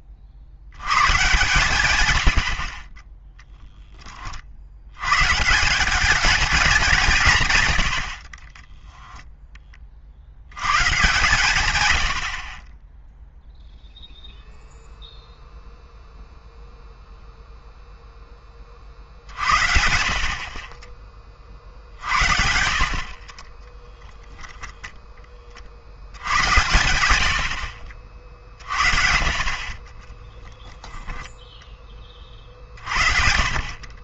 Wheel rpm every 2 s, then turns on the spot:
130, 0, 180, 110, 10, 130, 0, 0, 0, 70, 40, 40, 20, 70, 40, 10, 40.
22-24 26-28 30-32